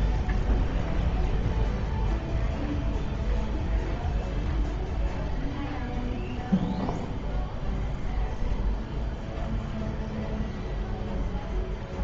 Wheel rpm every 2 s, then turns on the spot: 0, 0, 0, 0, 0, 0.
none